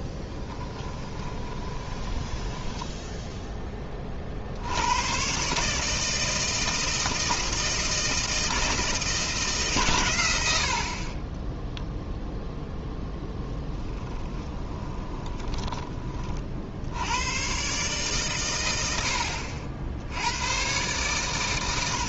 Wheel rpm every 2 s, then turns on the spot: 20, 10, 60, 160, 160, 80, 0, 20, 40, 120, 110.
0-4 14-16